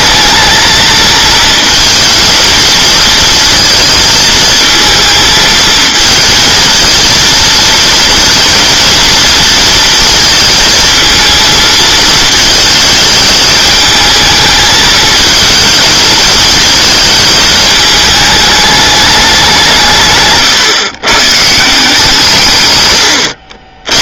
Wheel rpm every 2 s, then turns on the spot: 220, 230, 220, 230, 230, 220, 220, 220, 220, 210, 130, 120.
none